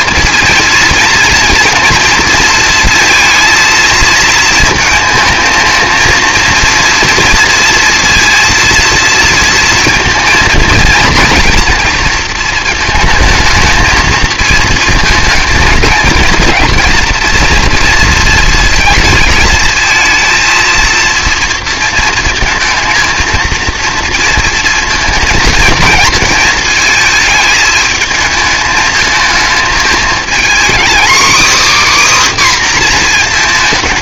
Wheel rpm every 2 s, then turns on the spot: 230, 230, 220, 230, 230, 220, 220, 220, 230, 220, 230, 220, 230, 220, 220, 240, 260.
none